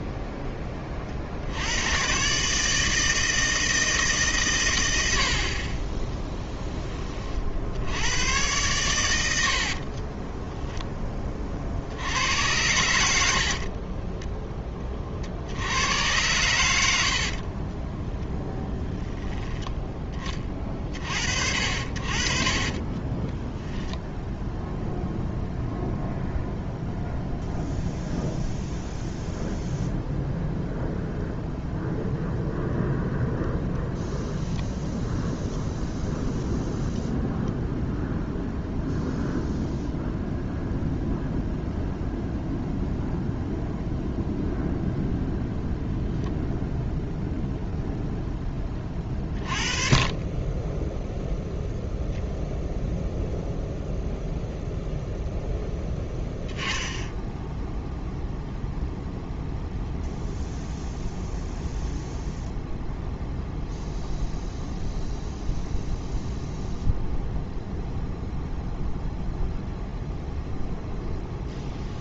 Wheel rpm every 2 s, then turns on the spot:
20, 150, 100, 10, 110, 10, 80, 10, 100, 10, 30, 30, 0, 0, 0, 0, 0, 0, 0, 0, 0, 0, 0, 0, 30, 10, 0, 0, 0, 0, 0, 0, 0, 0, 0, 0.
22-24 50-52